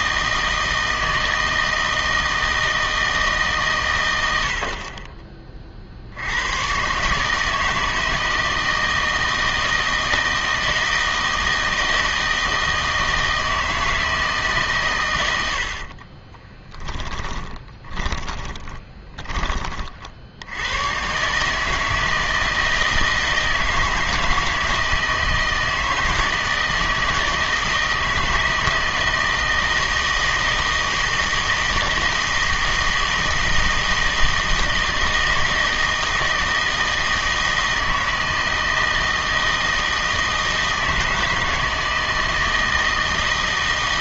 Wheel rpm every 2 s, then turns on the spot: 160, 160, 70, 110, 160, 160, 160, 140, 20, 20, 90, 160, 160, 160, 160, 160, 160, 160, 160, 160, 160, 160.
16-20